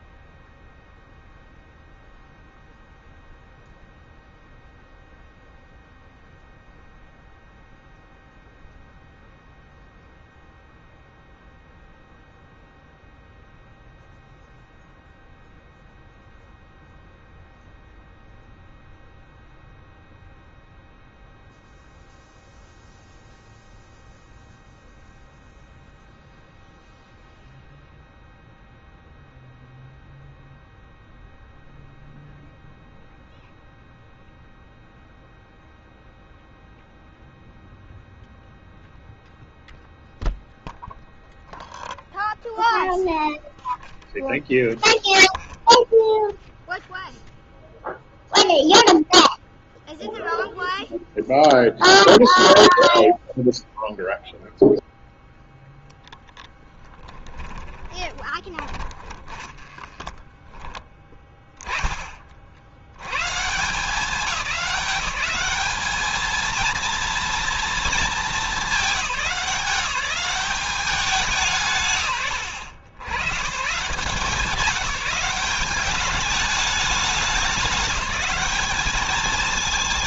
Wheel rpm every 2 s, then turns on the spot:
0, 0, 0, 0, 0, 0, 0, 0, 0, 0, 0, 0, 0, 0, 0, 0, 0, 0, 0, 0, 0, 0, 0, 0, 0, 0, 0, 0, 10, 20, 20, 70, 200, 220, 210, 200, 90, 190, 200, 210.
56-60